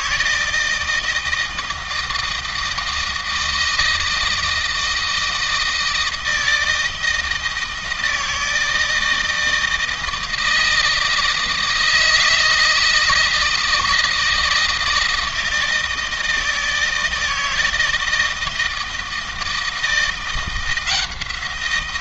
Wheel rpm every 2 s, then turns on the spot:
160, 160, 160, 160, 160, 160, 160, 160, 160, 160, 170.
none